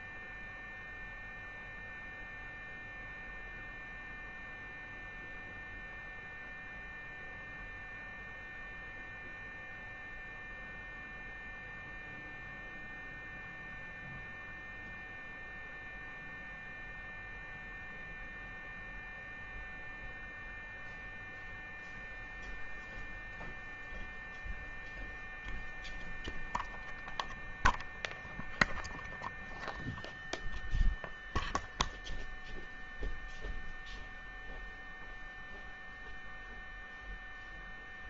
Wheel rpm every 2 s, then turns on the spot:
0, 0, 0, 0, 0, 0, 0, 0, 0, 0, 0, 0, 0, 0, 0, 0, 0, 0, 0.
none